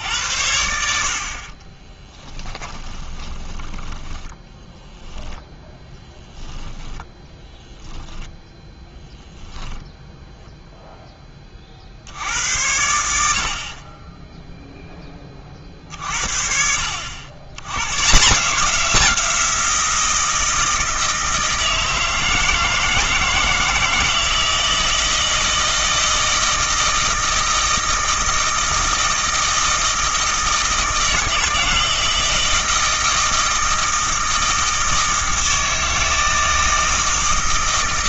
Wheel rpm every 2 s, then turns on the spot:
70, 20, 0, 10, 0, 0, 80, 0, 60, 180, 160, 160, 160, 160, 160, 160, 160, 160, 160.
2-4 6-8